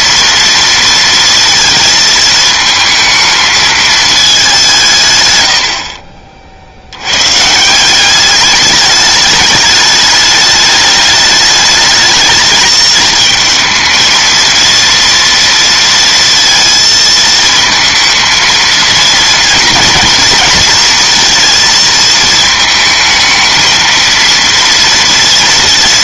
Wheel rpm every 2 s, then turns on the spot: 230, 220, 160, 80, 210, 210, 220, 230, 230, 230, 230, 220, 230.
none